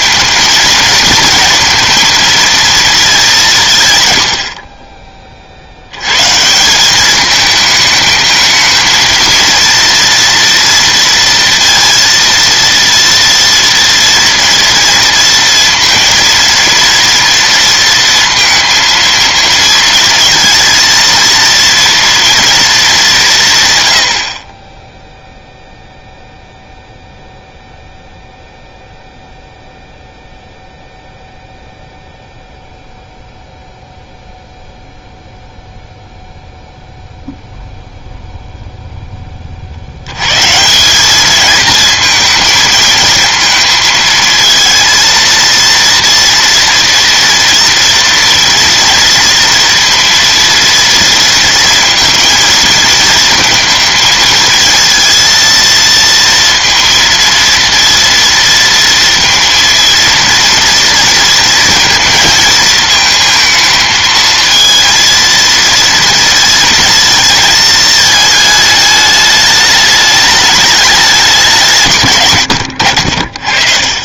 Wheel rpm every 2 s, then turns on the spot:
220, 220, 40, 180, 220, 230, 230, 230, 230, 230, 230, 220, 20, 0, 0, 0, 0, 0, 0, 0, 180, 230, 230, 230, 230, 230, 220, 230, 230, 230, 240, 220, 230, 220, 210, 210, 90.
none